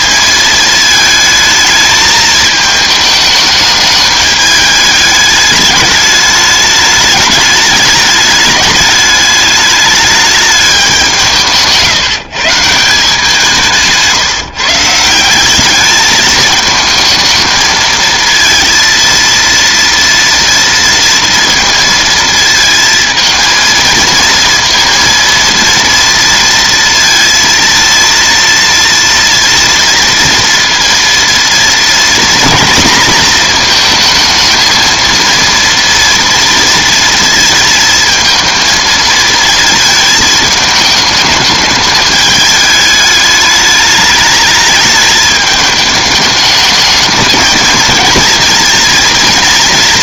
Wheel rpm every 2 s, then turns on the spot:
220, 220, 210, 210, 210, 210, 160, 150, 210, 230, 230, 230, 230, 230, 230, 230, 230, 220, 230, 230, 220, 210, 210, 220, 230.
none